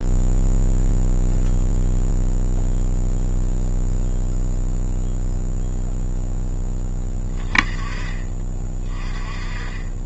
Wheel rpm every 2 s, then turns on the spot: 0, 0, 0, 20, 30.
none